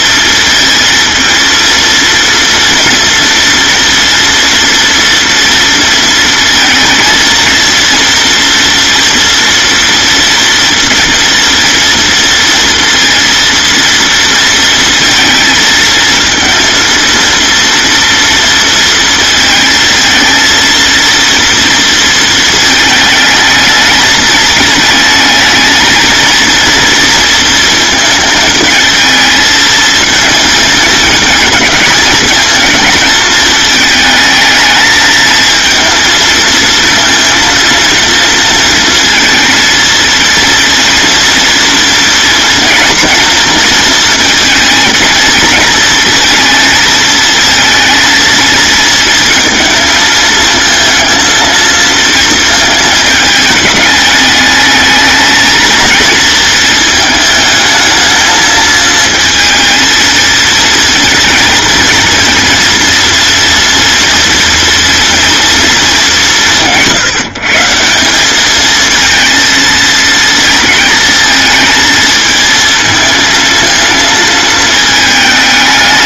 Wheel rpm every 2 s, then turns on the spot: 230, 230, 230, 230, 230, 230, 230, 230, 230, 230, 230, 220, 220, 230, 220, 230, 220, 220, 230, 230, 230, 230, 220, 230, 220, 230, 220, 220, 220, 230, 230, 230, 230, 160, 220, 220, 230, 210.
none